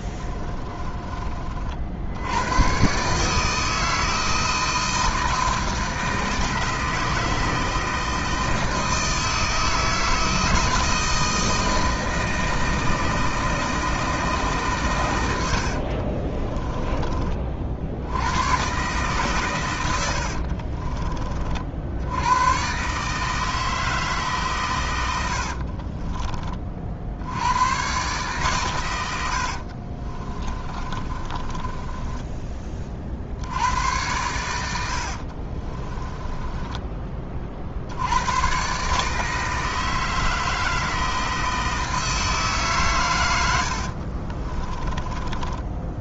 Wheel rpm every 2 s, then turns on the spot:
20, 120, 160, 160, 160, 160, 160, 130, 20, 130, 30, 140, 120, 60, 110, 30, 40, 80, 20, 140, 160, 130, 20.
0-2 16-18 20-22 30-32 34-38 44-46